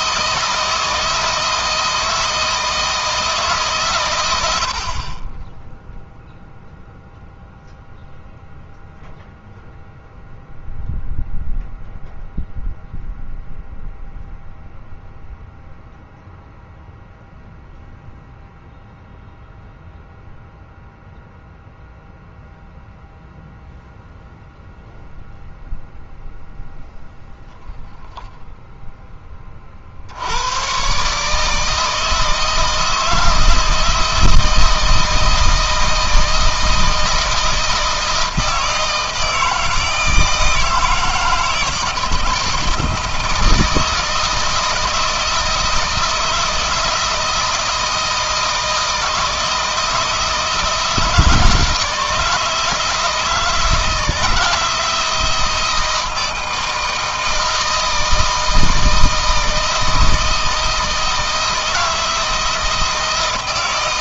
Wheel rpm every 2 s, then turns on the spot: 160, 160, 50, 0, 0, 0, 0, 0, 0, 0, 0, 0, 0, 0, 10, 130, 160, 160, 160, 160, 160, 160, 160, 160, 160, 160, 160, 160, 160, 160, 160, 160.
none